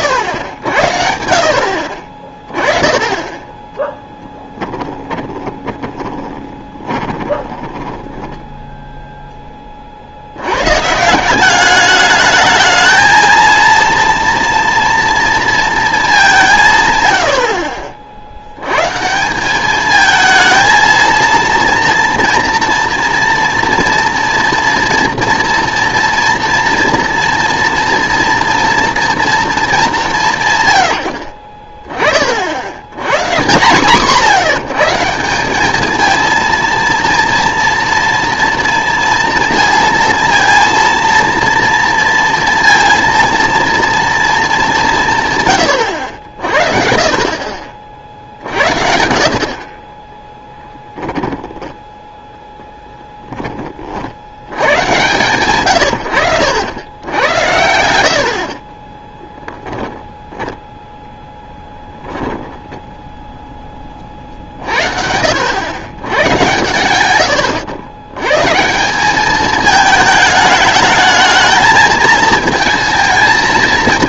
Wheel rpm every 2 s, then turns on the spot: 90, 20, 20, 30, 0, 100, 220, 230, 160, 90, 220, 230, 230, 230, 230, 110, 90, 170, 230, 230, 230, 230, 200, 50, 70, 10, 10, 90, 80, 50, 0, 10, 50, 110, 160, 210, 220.
4-8 50-54 62-64